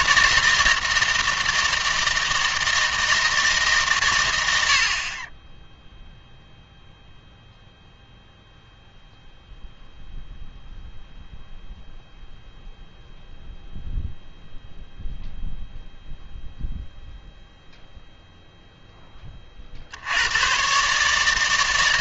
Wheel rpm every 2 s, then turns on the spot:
160, 160, 70, 0, 0, 0, 0, 0, 0, 0, 140.
none